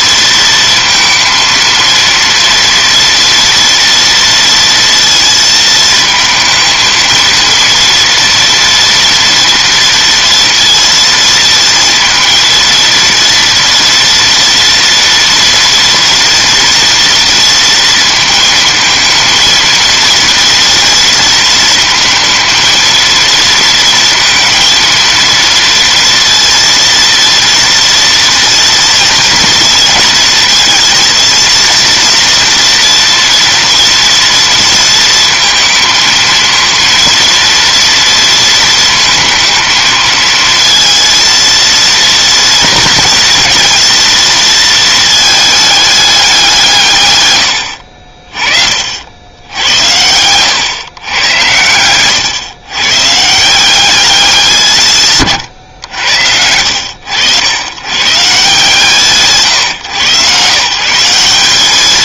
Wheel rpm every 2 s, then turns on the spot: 230, 230, 230, 220, 230, 230, 230, 240, 240, 230, 230, 230, 230, 230, 230, 230, 230, 230, 230, 230, 230, 230, 220, 140, 60, 120, 130, 170, 80, 150, 160.
none